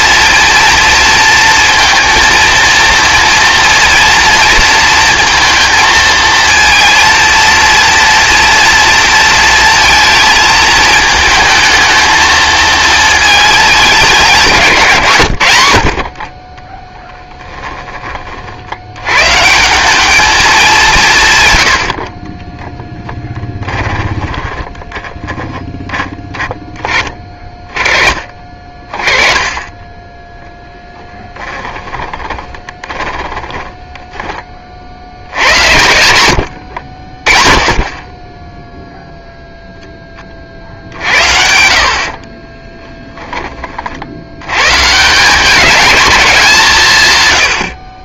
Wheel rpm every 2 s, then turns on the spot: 230, 230, 230, 230, 230, 220, 220, 150, 10, 80, 190, 10, 10, 20, 30, 10, 20, 60, 50, 0, 60, 10, 140, 160.
16-18 22-26 30-34 42-44